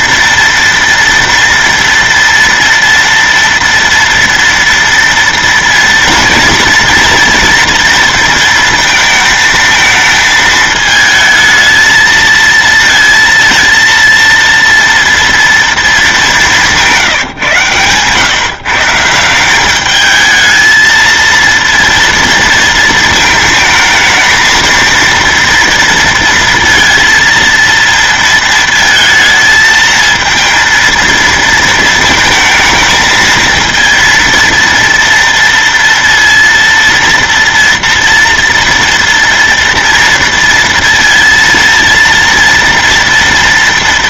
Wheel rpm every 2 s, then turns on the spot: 240, 230, 230, 230, 230, 220, 230, 230, 190, 150, 220, 230, 220, 230, 230, 230, 220, 230, 230, 230, 230, 230.
16-18